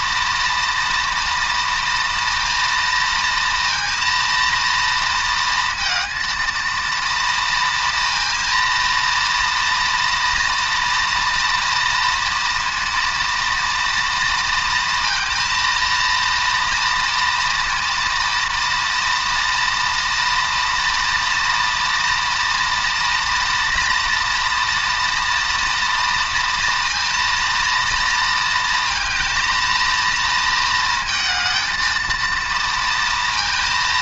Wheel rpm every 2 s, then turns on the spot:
240, 230, 230, 230, 230, 230, 230, 230, 230, 230, 230, 230, 230, 230, 230, 230, 230.
none